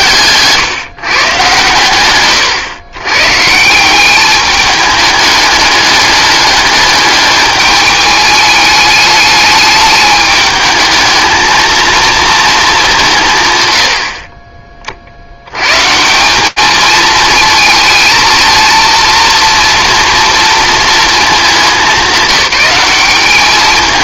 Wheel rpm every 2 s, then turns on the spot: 150, 130, 210, 210, 210, 220, 210, 40, 210, 230, 230, 190.
none